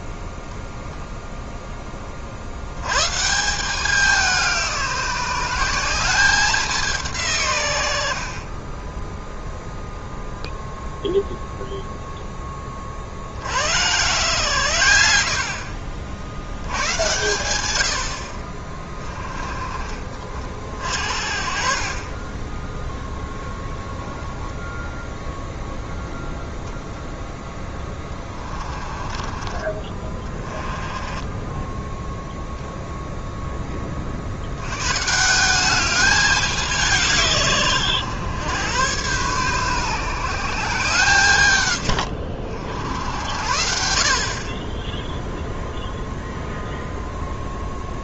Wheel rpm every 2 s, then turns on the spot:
0, 70, 180, 190, 30, 0, 20, 100, 90, 30, 40, 10, 10, 0, 30, 20, 0, 100, 180, 110, 160, 70, 30, 0.
8-10 28-32 44-46